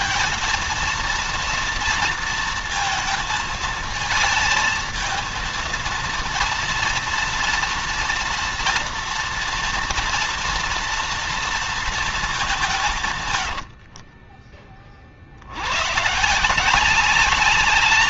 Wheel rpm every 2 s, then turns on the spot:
230, 230, 230, 230, 240, 230, 140, 50, 190.
none